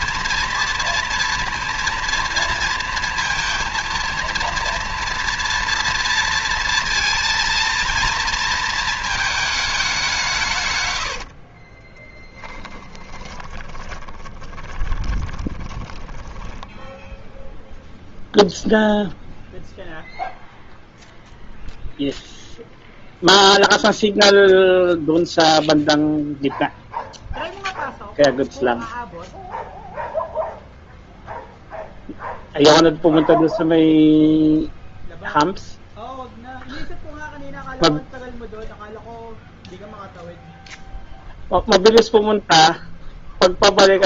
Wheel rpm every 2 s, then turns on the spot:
230, 230, 230, 230, 220, 120, 20, 20, 10, 0, 0, 0, 0, 0, 0, 0, 0, 0, 0, 0, 0, 0.
10-18